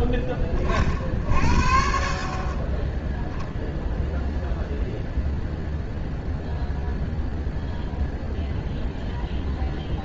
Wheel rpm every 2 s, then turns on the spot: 20, 30, 0, 0, 0.
none